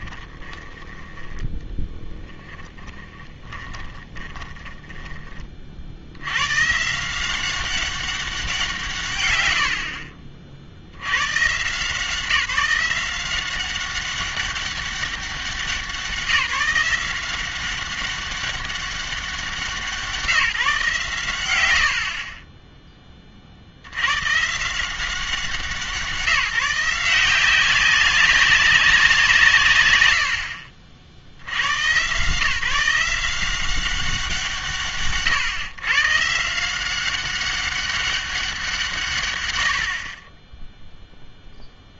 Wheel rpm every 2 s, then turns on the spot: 10, 10, 20, 130, 170, 80, 180, 200, 170, 200, 140, 20, 170, 170, 190, 50, 160, 150, 170, 170, 0.
0-6 22-24